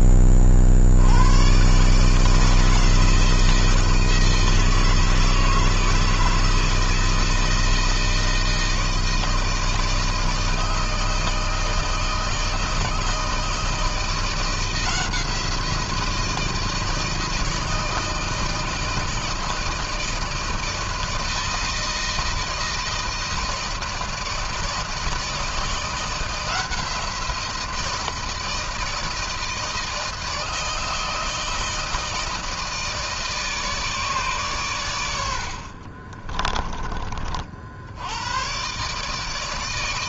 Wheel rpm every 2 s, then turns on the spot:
70, 160, 160, 160, 160, 160, 160, 170, 160, 160, 160, 160, 160, 170, 160, 160, 160, 110, 40, 130.
none